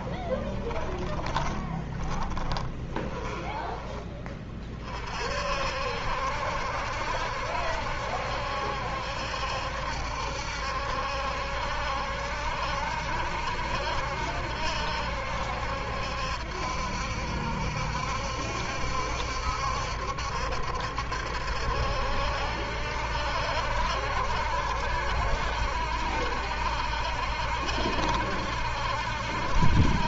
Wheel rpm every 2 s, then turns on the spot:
20, 20, 30, 70, 70, 70, 70, 70, 70, 70, 70, 70, 70, 70, 70.
0-4